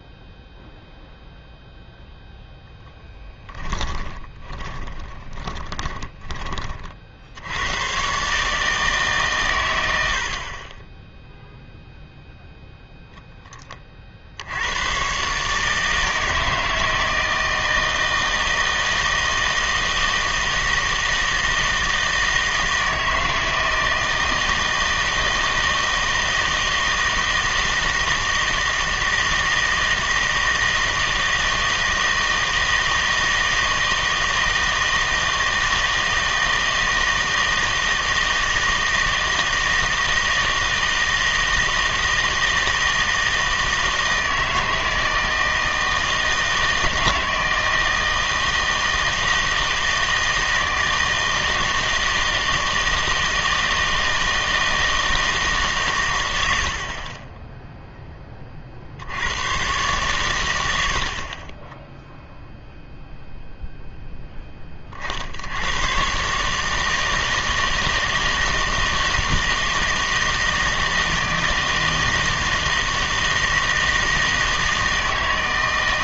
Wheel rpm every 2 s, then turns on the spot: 0, 10, 30, 40, 150, 30, 0, 80, 160, 160, 160, 160, 160, 160, 160, 160, 160, 160, 160, 160, 160, 160, 160, 160, 160, 160, 160, 160, 70, 30, 90, 0, 30, 150, 160, 160, 160, 160.
4-6